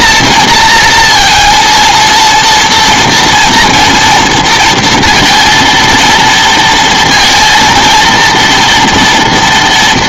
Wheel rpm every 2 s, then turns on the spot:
230, 240, 230, 230, 230.
none